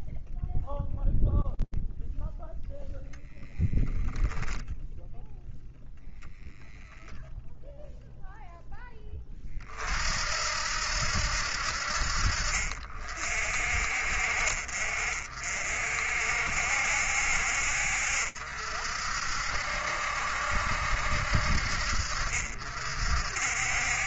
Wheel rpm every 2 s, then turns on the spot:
0, 0, 0, 0, 60, 50, 50, 70, 60, 70, 60, 70.
none